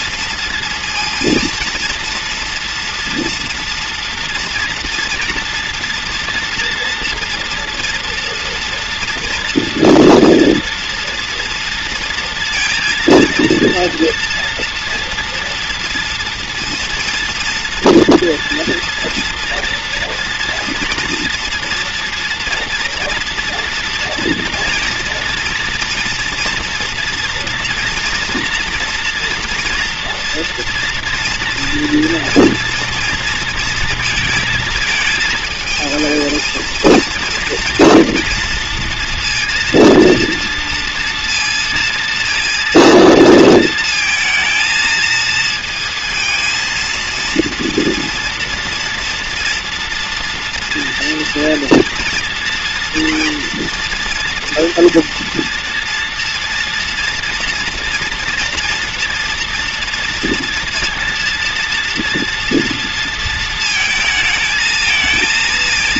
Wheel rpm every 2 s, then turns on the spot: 230, 240, 240, 230, 230, 240, 230, 230, 230, 230, 230, 230, 230, 230, 230, 230, 230, 220, 220, 230, 230, 230, 230, 230, 230, 240, 240, 230, 230, 230, 230, 230, 230.
none